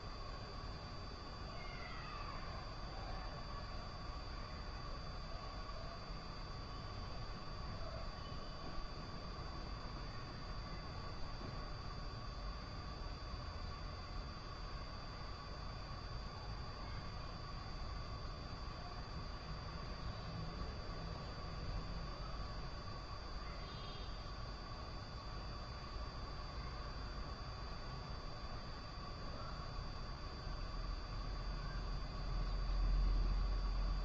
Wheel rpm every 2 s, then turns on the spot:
0, 0, 0, 0, 0, 0, 0, 0, 0, 0, 0, 0, 0, 0, 0, 0, 0.
none